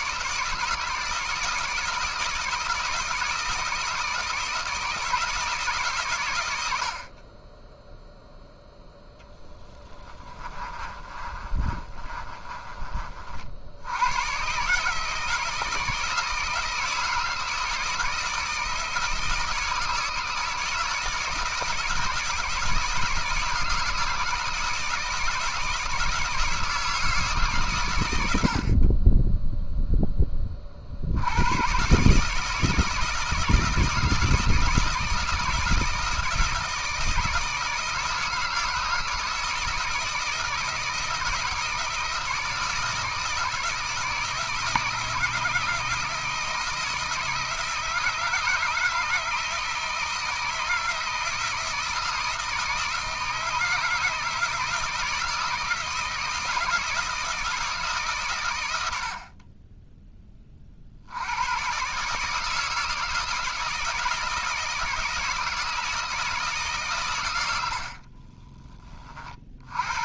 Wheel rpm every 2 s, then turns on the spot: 160, 160, 160, 50, 0, 30, 40, 150, 160, 160, 160, 160, 160, 160, 30, 60, 160, 160, 160, 170, 160, 160, 160, 160, 160, 160, 160, 160, 160, 80, 60, 160, 160, 140, 40.
10-12